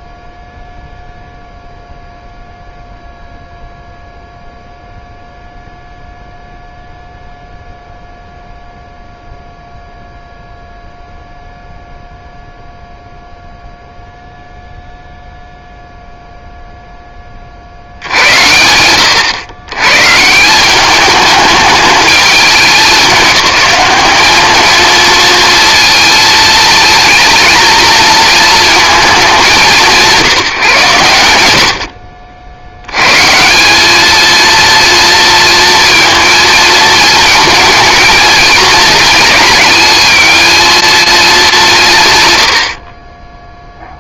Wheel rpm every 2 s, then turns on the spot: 0, 0, 0, 0, 0, 0, 0, 0, 10, 90, 210, 190, 220, 220, 210, 140, 100, 230, 220, 230, 220, 30.
none